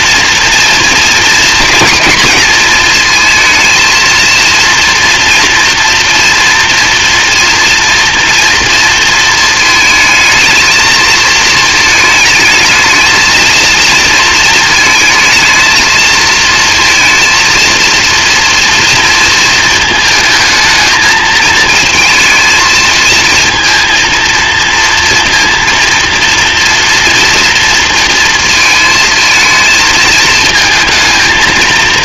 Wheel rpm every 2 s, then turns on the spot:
230, 220, 230, 230, 240, 220, 220, 230, 230, 230, 220, 220, 230, 240, 220, 220.
none